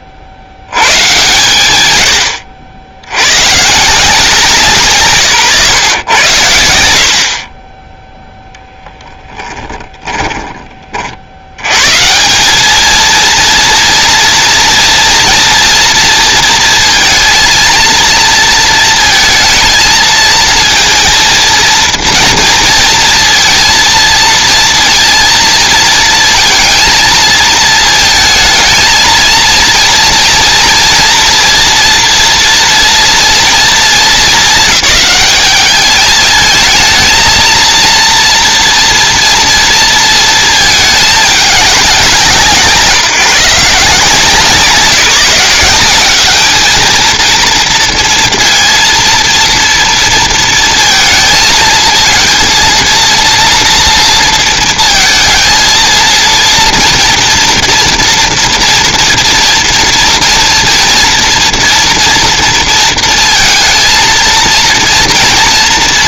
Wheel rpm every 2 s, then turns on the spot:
60, 60, 150, 80, 0, 30, 210, 230, 230, 230, 230, 230, 230, 220, 220, 230, 230, 200, 220, 230, 220, 160, 170, 220, 230, 230, 230, 230, 230, 230, 230, 230, 230.
none